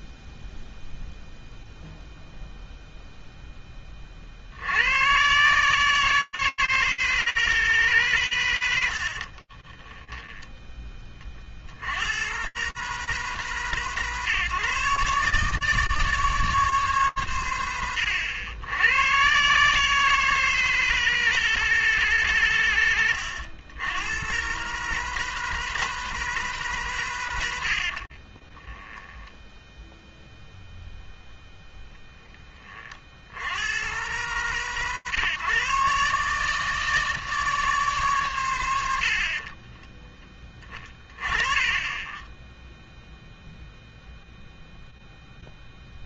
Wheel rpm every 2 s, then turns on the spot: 0, 0, 110, 160, 90, 30, 150, 150, 130, 120, 160, 100, 150, 130, 10, 0, 40, 140, 160, 90, 30, 0, 0.
28-30